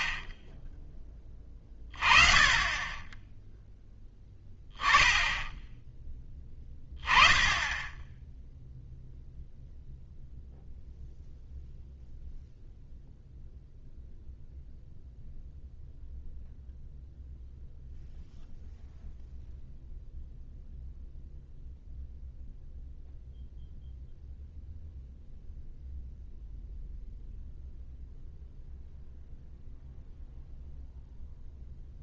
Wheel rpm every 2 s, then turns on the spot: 10, 30, 10, 10, 0, 0, 0, 0, 0, 0, 0, 0, 0, 0, 0, 0.
none